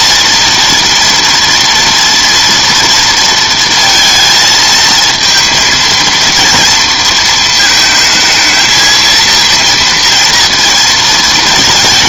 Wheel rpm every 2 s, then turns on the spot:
230, 230, 220, 230, 220, 230.
none